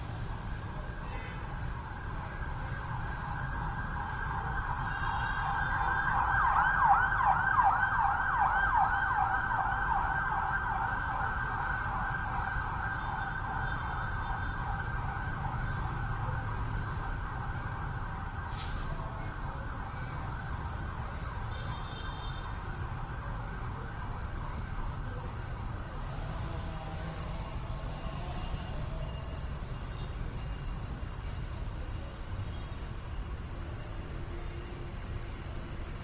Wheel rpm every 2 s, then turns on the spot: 0, 0, 0, 0, 0, 0, 0, 0, 0, 0, 0, 0, 0, 0, 0, 0, 0, 0.
none